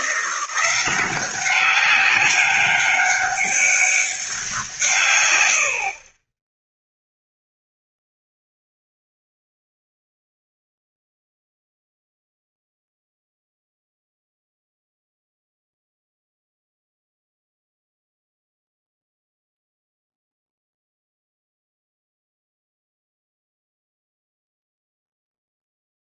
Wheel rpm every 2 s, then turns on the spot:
180, 200, 160, 0, 0, 0, 0, 0, 0, 0, 0, 0, 0.
none